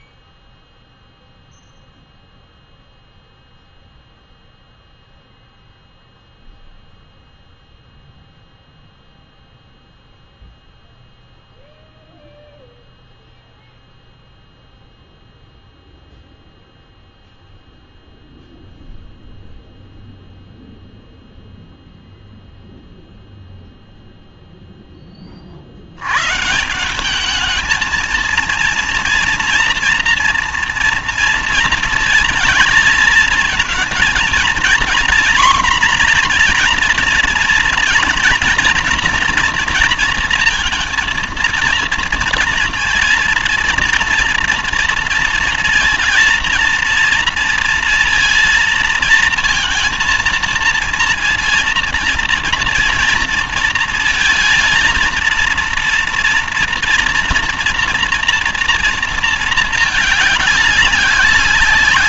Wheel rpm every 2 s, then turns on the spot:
0, 0, 0, 0, 0, 0, 0, 0, 0, 0, 0, 0, 0, 150, 230, 230, 220, 230, 250, 230, 230, 220, 230, 230, 230, 230, 230, 220, 230, 230, 200.
none